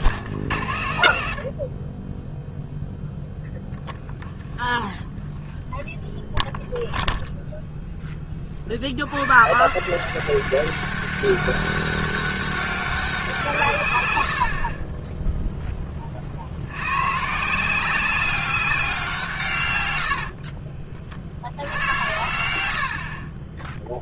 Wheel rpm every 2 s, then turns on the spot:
100, 0, 0, 0, 90, 200, 190, 20, 90, 190, 40, 70.
22-24